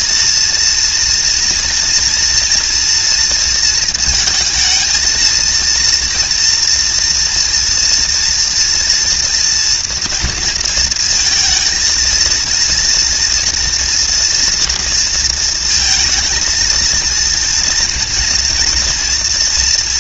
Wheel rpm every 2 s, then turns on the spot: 230, 230, 220, 230, 240, 230, 230, 230, 230, 230.
none